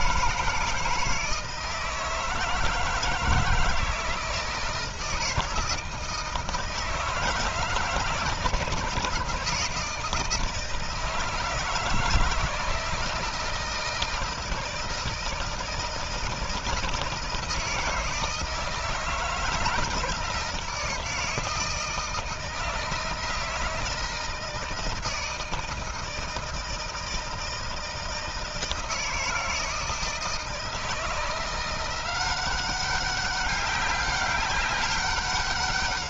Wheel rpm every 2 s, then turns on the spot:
160, 160, 160, 160, 160, 160, 160, 160, 160, 160, 160, 160, 160, 160, 160, 160, 190, 200.
none